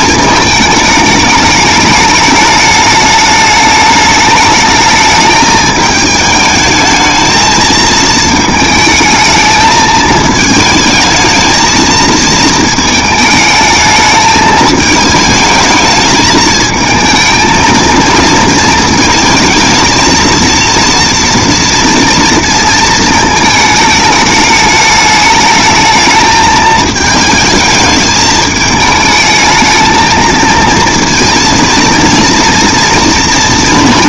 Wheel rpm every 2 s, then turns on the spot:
210, 210, 210, 220, 220, 220, 220, 220, 220, 230, 230, 230, 210, 220, 220, 230, 230.
none